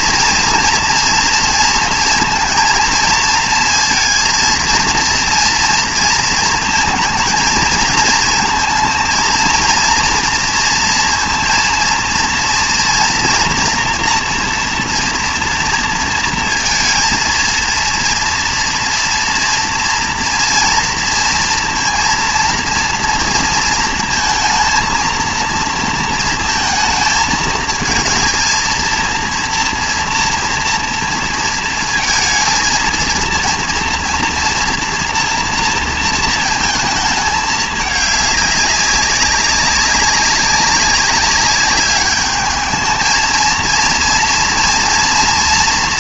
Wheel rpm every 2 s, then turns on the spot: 240, 230, 230, 220, 230, 230, 230, 230, 230, 230, 230, 230, 230, 220, 220, 230, 230, 230, 220, 200, 190, 210, 240.
none